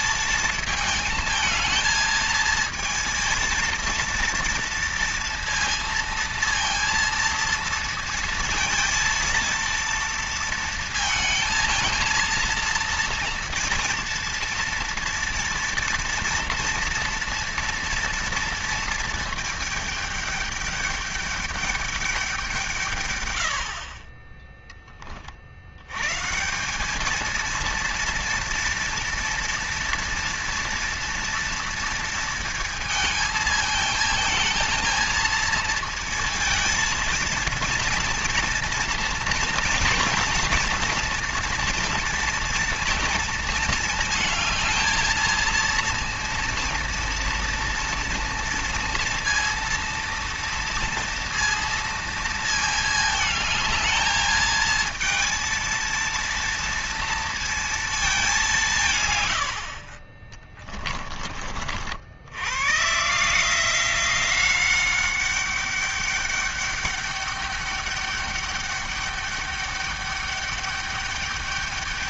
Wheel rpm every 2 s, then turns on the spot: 220, 230, 230, 230, 230, 230, 230, 230, 230, 230, 210, 160, 20, 190, 230, 230, 230, 220, 230, 230, 240, 230, 220, 230, 230, 230, 220, 220, 230, 160, 20, 130, 190, 200, 200, 200.
none